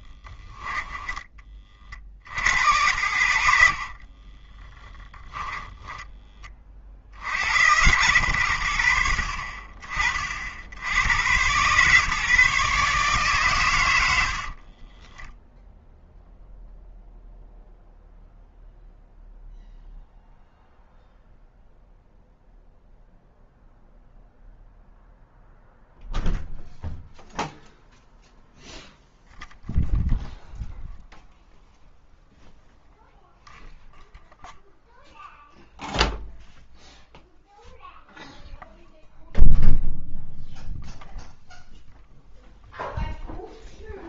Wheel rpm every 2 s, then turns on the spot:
10, 70, 10, 40, 70, 70, 140, 30, 0, 0, 0, 0, 0, 0, 0, 0, 0, 0, 0, 0, 0, 0.
0-2 4-6 14-16